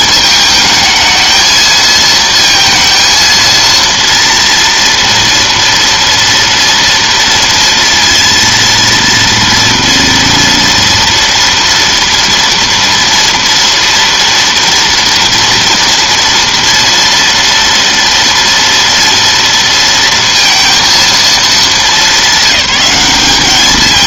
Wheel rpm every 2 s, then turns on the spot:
220, 230, 230, 230, 230, 230, 230, 230, 230, 230, 230, 200.
none